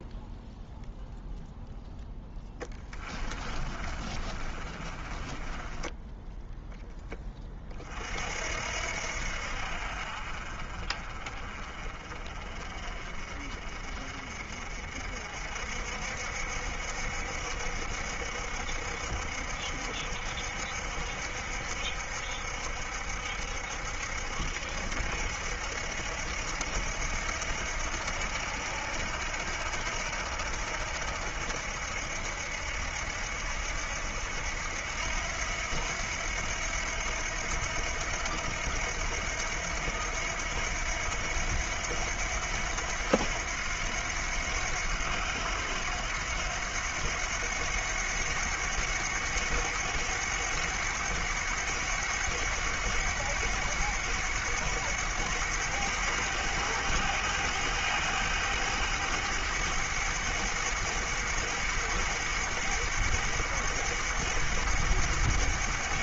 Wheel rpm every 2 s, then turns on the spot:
0, 20, 30, 10, 60, 40, 40, 50, 60, 70, 60, 70, 70, 80, 80, 70, 70, 80, 80, 80, 90, 90, 90, 90, 100, 100, 100, 100, 100, 100, 100, 100, 100.
2-6